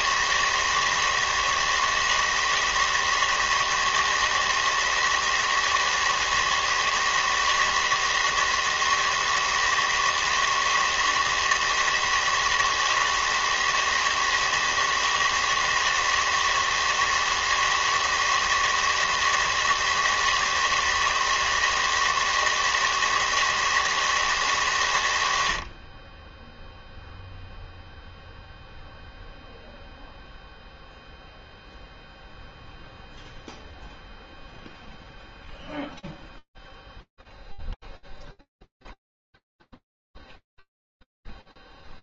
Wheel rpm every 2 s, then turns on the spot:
160, 160, 160, 160, 160, 160, 160, 160, 160, 160, 160, 160, 110, 0, 0, 0, 0, 0, 0, 0, 0.
none